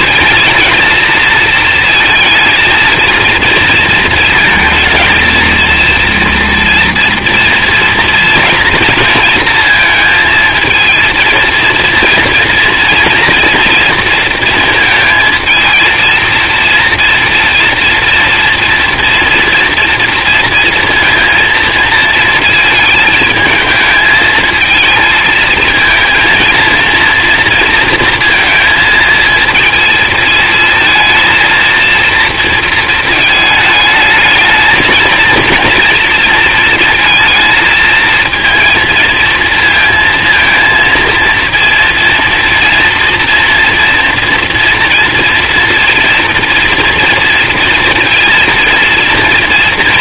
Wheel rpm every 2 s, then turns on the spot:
230, 230, 230, 230, 220, 230, 240, 220, 230, 230, 230, 220, 220, 230, 230, 230, 220, 230, 220, 230, 230, 240, 230, 230, 230.
none